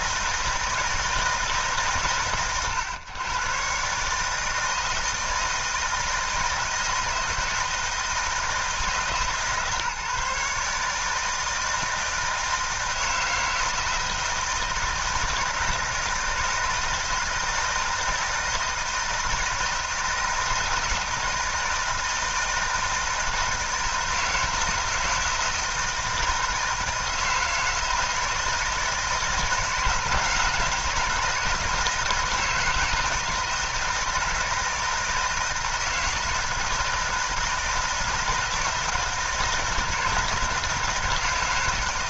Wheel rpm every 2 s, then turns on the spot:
160, 110, 160, 160, 160, 150, 160, 160, 160, 160, 160, 160, 160, 160, 160, 160, 160, 160, 170, 160, 160.
none